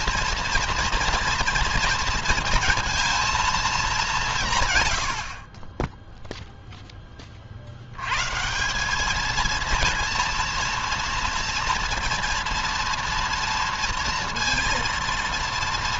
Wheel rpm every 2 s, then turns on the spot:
230, 230, 100, 20, 200, 230, 230, 230.
none